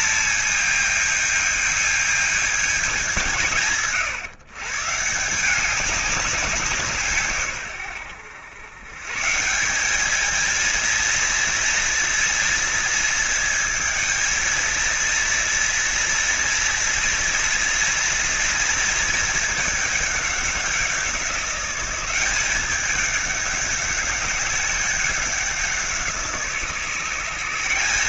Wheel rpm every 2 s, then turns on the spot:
220, 200, 140, 170, 110, 230, 220, 230, 230, 230, 180, 200, 190, 160.
none